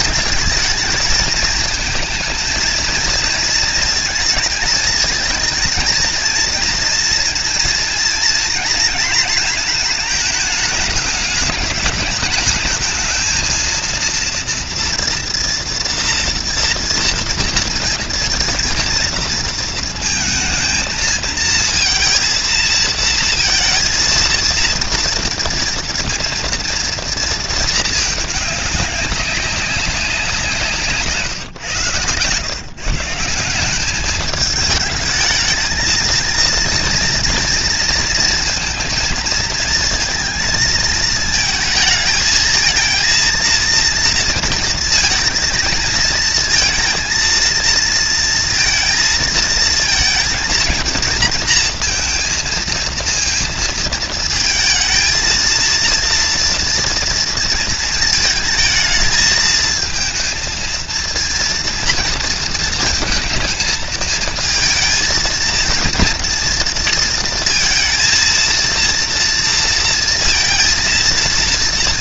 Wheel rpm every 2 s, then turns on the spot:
220, 230, 220, 230, 230, 210, 220, 230, 230, 230, 220, 230, 230, 230, 200, 160, 160, 210, 230, 230, 230, 230, 230, 230, 230, 230, 230, 230, 230, 220, 230, 220, 230, 230, 230, 230.
none